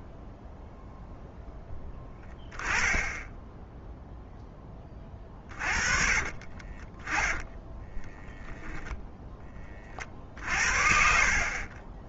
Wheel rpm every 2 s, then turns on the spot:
0, 10, 10, 30, 0, 60.
6-8